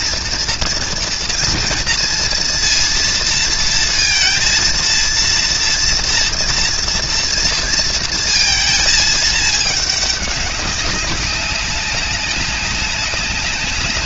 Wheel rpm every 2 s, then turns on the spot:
230, 230, 230, 230, 230, 200, 200.
none